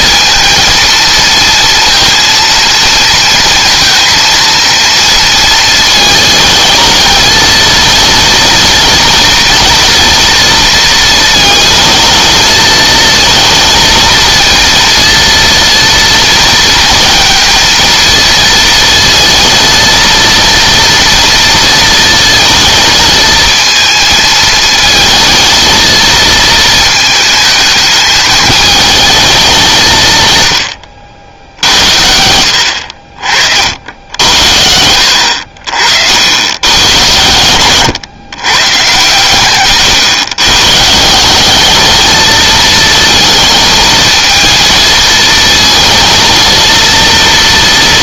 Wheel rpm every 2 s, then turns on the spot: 230, 230, 230, 220, 230, 230, 220, 230, 230, 230, 230, 220, 220, 220, 220, 90, 70, 80, 110, 130, 130, 220, 230, 230.
none